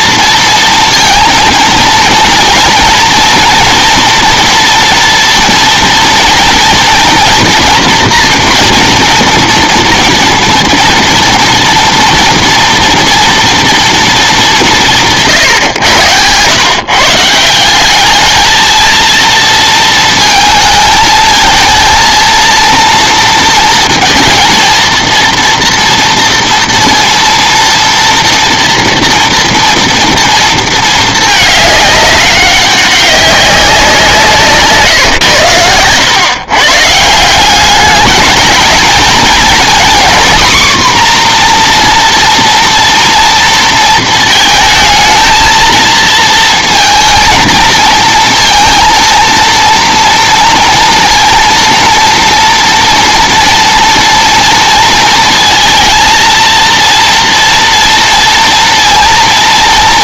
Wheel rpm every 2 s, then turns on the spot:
230, 230, 240, 230, 240, 230, 240, 190, 120, 220, 220, 230, 230, 230, 230, 230, 190, 150, 130, 230, 260, 230, 220, 230, 230, 230, 230, 230, 230, 230.
none